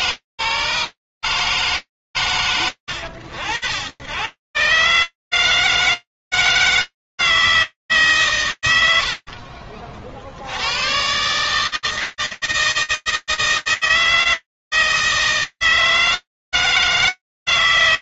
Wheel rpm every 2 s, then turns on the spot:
110, 150, 160, 90, 130, 160, 160, 160, 160.
none